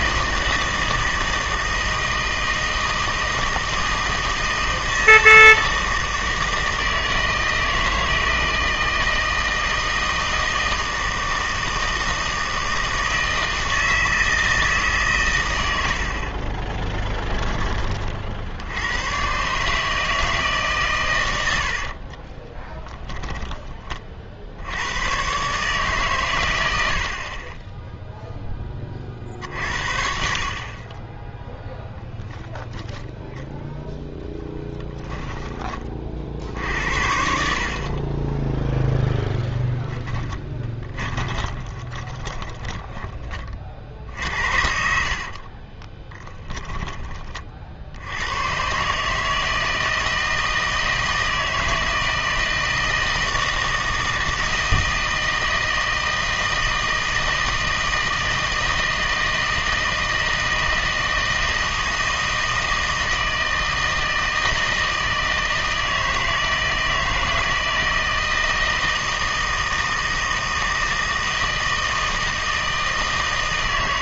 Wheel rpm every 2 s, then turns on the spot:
160, 160, 160, 160, 160, 160, 160, 150, 20, 100, 130, 10, 80, 90, 30, 20, 0, 10, 70, 10, 20, 10, 60, 20, 130, 160, 160, 160, 160, 160, 160, 160, 160, 160, 160, 160, 160.
16-18 22-24 34-36 40-48